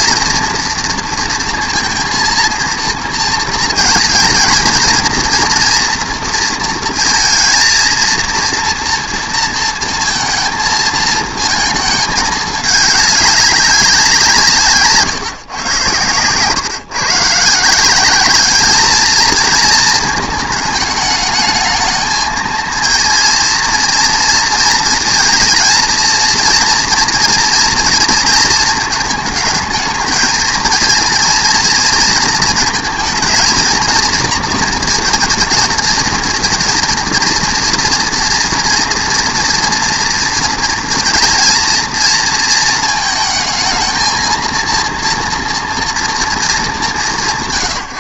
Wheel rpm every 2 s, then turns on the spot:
230, 230, 230, 230, 230, 230, 210, 160, 130, 210, 210, 230, 230, 230, 220, 230, 220, 230, 230, 230, 240, 230, 230, 210.
none